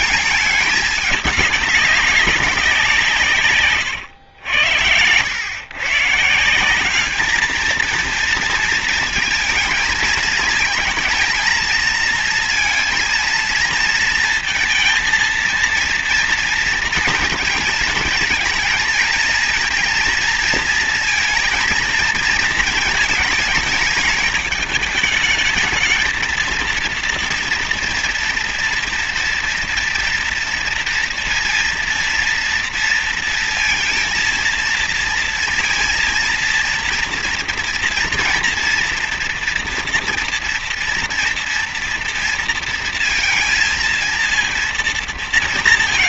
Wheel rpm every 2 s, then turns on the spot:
210, 180, 100, 190, 230, 220, 230, 230, 230, 220, 230, 220, 220, 230, 240, 230, 230, 230, 230, 230, 230, 230, 230.
none